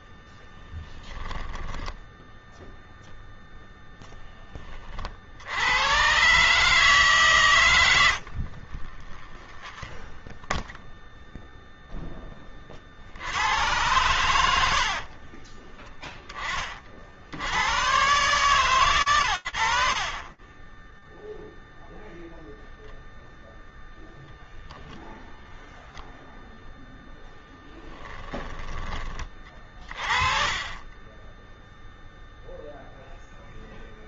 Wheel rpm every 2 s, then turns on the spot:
10, 0, 30, 150, 40, 0, 50, 40, 70, 120, 0, 0, 0, 10, 30, 10, 0.
0-2 8-10 14-16 26-32